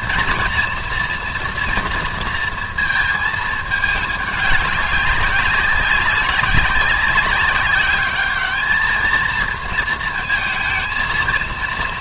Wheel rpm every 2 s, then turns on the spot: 230, 220, 190, 190, 220, 230.
none